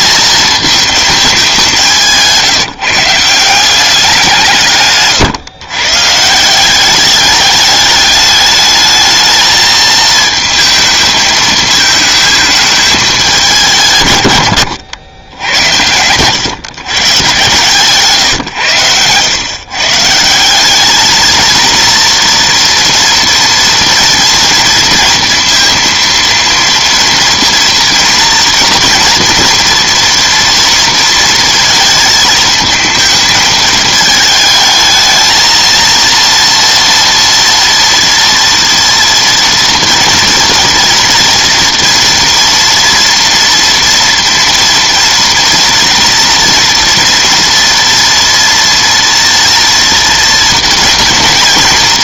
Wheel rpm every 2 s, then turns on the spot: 220, 160, 150, 180, 210, 230, 210, 100, 130, 110, 190, 240, 230, 230, 230, 230, 220, 220, 230, 230, 230, 230, 230, 230, 230, 230.
14-16